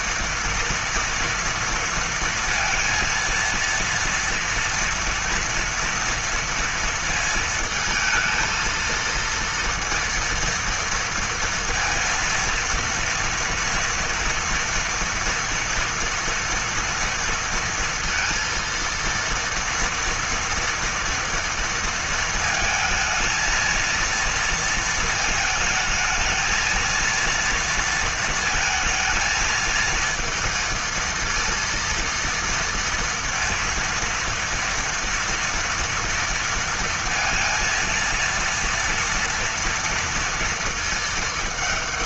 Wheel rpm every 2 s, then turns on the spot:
230, 230, 230, 230, 230, 230, 230, 230, 230, 230, 230, 220, 230, 230, 220, 230, 230, 230, 230, 230, 230.
none